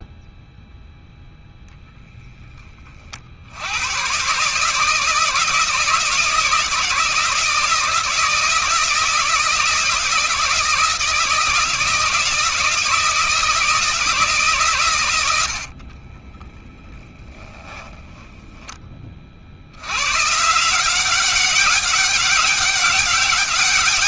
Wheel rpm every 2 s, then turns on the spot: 0, 10, 130, 160, 160, 160, 160, 140, 20, 10, 140, 190.
16-18